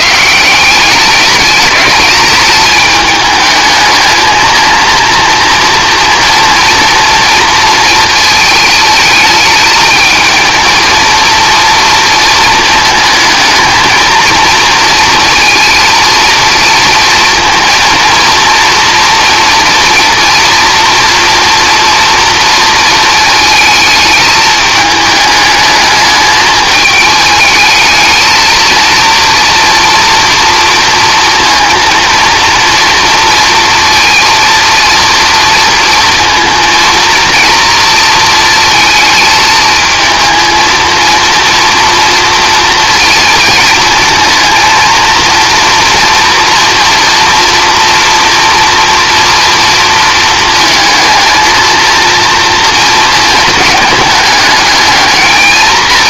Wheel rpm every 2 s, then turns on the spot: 170, 210, 220, 230, 220, 230, 220, 230, 230, 230, 230, 230, 210, 210, 230, 230, 230, 230, 230, 230, 230, 240, 220, 230, 230, 220, 230, 210.
none